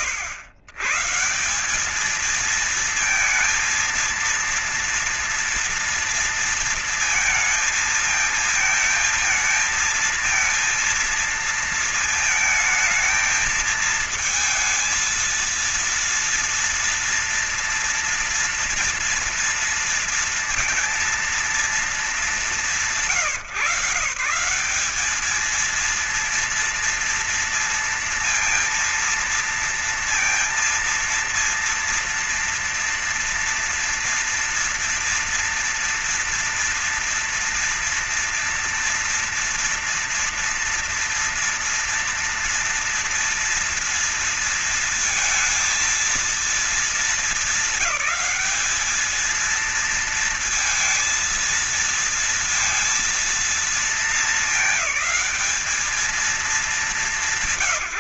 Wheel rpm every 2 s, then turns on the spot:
130, 230, 230, 230, 220, 230, 220, 230, 230, 230, 230, 180, 190, 230, 230, 230, 230, 230, 230, 240, 230, 230, 230, 210, 200, 230, 230, 220, 210.
none